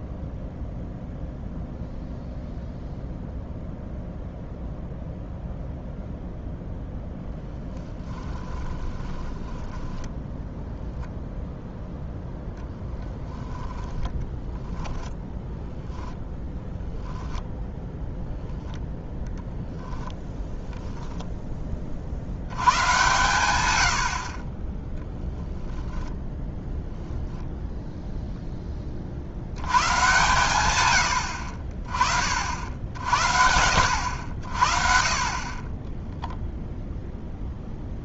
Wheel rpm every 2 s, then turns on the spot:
0, 0, 0, 0, 20, 0, 20, 10, 0, 10, 0, 100, 20, 10, 30, 120, 60, 50, 0.
8-10 12-14